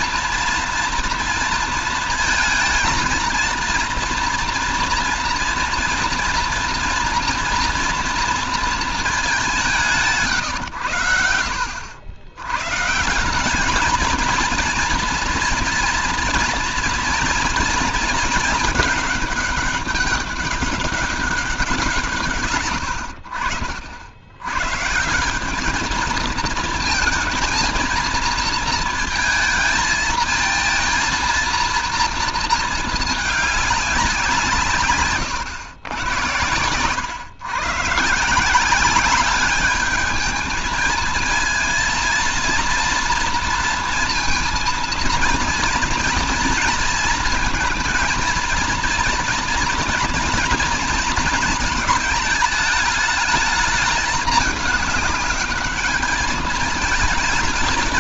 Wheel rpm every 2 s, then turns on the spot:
230, 220, 230, 230, 230, 110, 110, 230, 240, 220, 200, 110, 110, 230, 220, 230, 220, 150, 120, 170, 220, 230, 230, 230, 230, 230, 220, 210, 220.
none